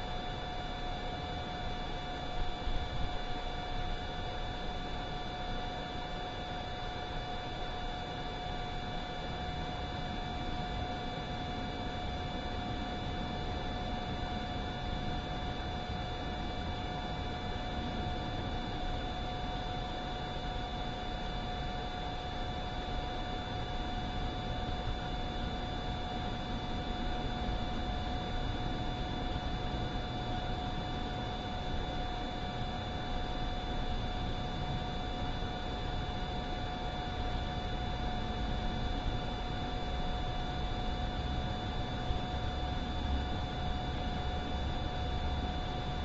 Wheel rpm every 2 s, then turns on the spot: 0, 0, 0, 0, 0, 0, 0, 0, 0, 0, 0, 0, 0, 0, 0, 0, 0, 0, 0, 0, 0, 0, 0.
none